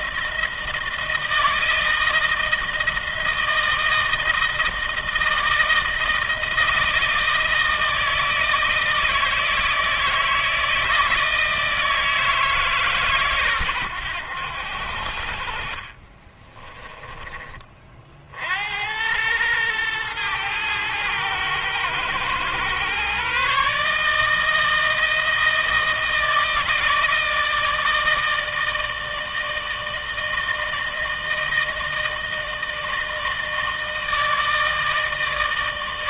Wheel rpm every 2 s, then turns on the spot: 160, 160, 160, 160, 160, 160, 160, 80, 20, 70, 110, 120, 160, 160, 160, 160, 160, 160.
16-18